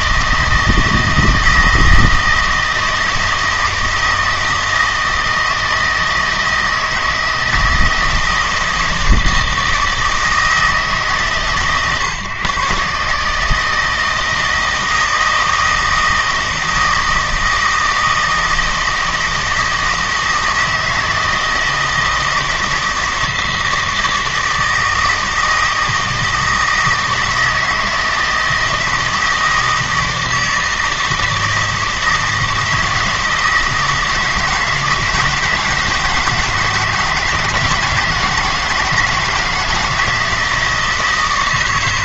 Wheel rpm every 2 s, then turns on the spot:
160, 160, 160, 160, 160, 150, 140, 160, 160, 160, 160, 160, 160, 160, 160, 160, 160, 160, 160, 160, 160.
none